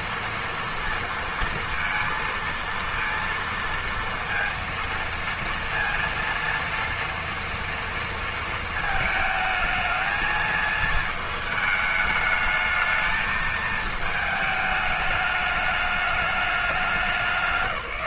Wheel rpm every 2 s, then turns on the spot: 230, 230, 230, 230, 220, 220, 210, 210, 200.
none